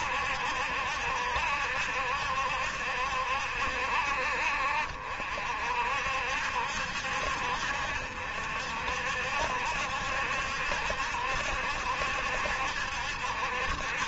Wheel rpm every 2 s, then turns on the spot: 70, 70, 60, 70, 60, 70, 70.
none